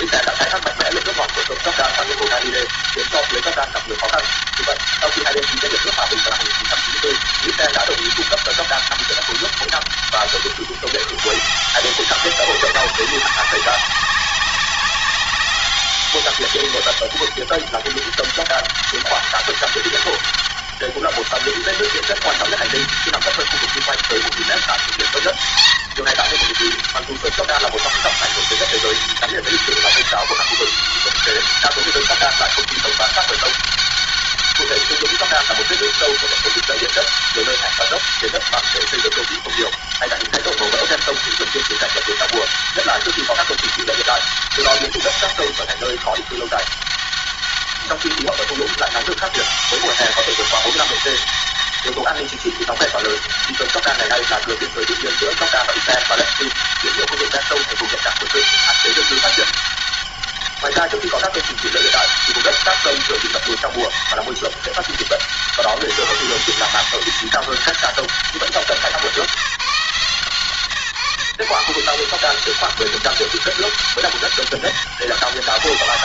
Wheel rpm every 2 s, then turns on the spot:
190, 200, 200, 200, 200, 200, 190, 200, 200, 200, 200, 200, 200, 210, 190, 170, 200, 200, 200, 200, 200, 200, 200, 200, 200, 200, 200, 200, 200, 200, 200, 200, 200, 200, 190, 150, 180, 200.
none